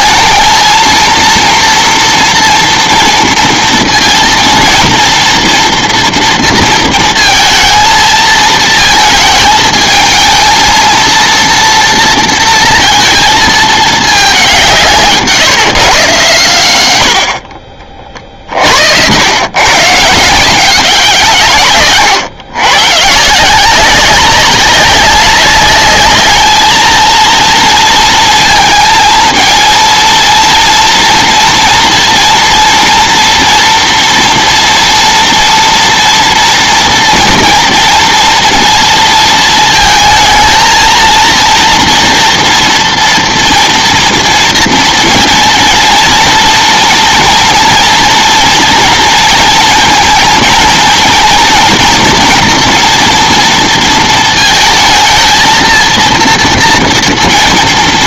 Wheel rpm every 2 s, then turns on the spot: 230, 230, 230, 230, 220, 230, 230, 170, 90, 80, 170, 130, 190, 230, 220, 230, 230, 230, 230, 230, 220, 230, 230, 230, 230, 230, 230, 220, 230.
none